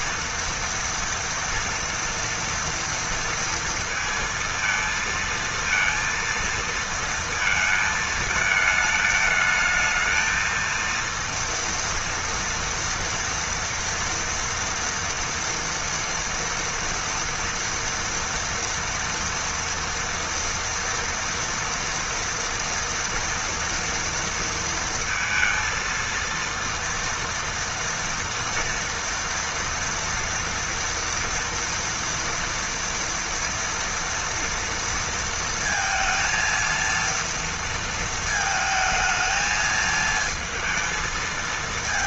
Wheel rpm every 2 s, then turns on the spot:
230, 230, 230, 230, 220, 230, 230, 230, 230, 230, 230, 230, 230, 230, 230, 240, 230, 230, 230, 220, 220.
none